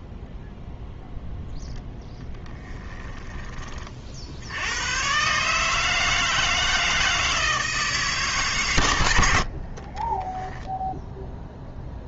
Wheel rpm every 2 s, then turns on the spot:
0, 10, 70, 160, 120, 10.
2-4